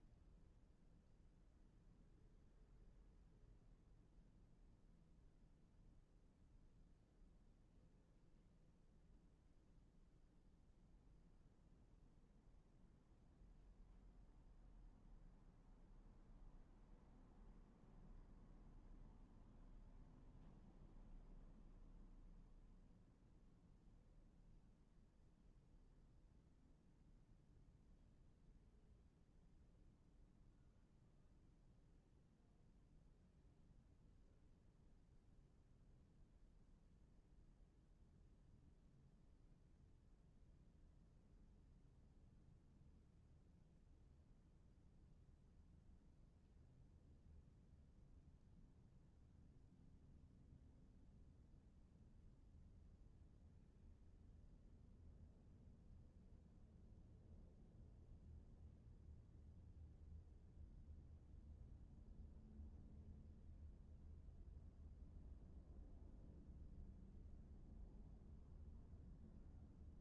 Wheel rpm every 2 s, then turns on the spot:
0, 0, 0, 0, 0, 0, 0, 0, 0, 0, 0, 0, 0, 0, 0, 0, 0, 0, 0, 0, 0, 0, 0, 0, 0, 0, 0, 0, 0, 0, 0, 0, 0, 0, 0.
none